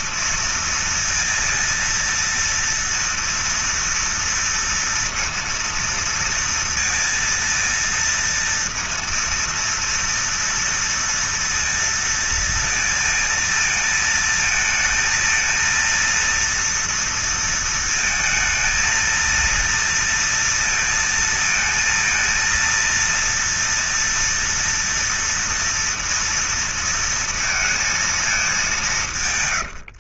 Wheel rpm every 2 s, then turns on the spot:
230, 230, 230, 230, 230, 230, 230, 230, 230, 220, 230, 230, 240, 230, 220.
none